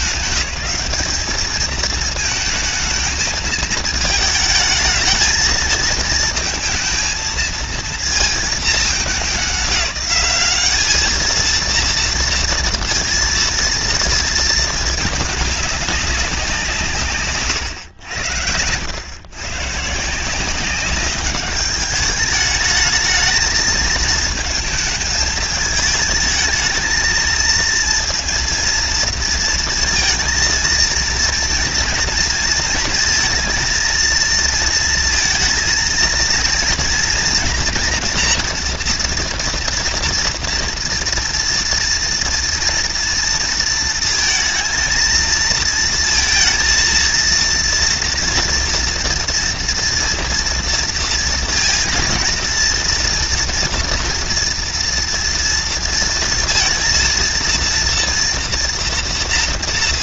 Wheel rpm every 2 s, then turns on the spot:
210, 220, 220, 220, 220, 210, 230, 210, 160, 100, 190, 210, 220, 220, 230, 230, 230, 230, 230, 230, 240, 230, 230, 230, 230, 230, 230, 230, 230, 230.
none